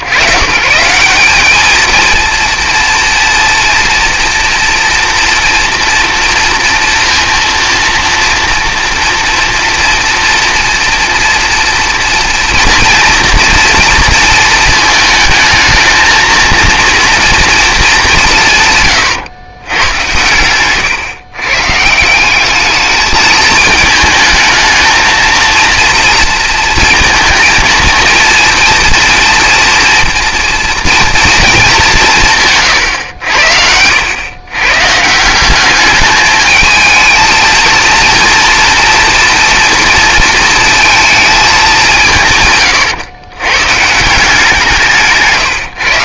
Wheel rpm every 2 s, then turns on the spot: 130, 230, 230, 230, 230, 230, 230, 220, 230, 140, 120, 210, 220, 230, 230, 230, 120, 140, 220, 230, 220, 120, 170.
none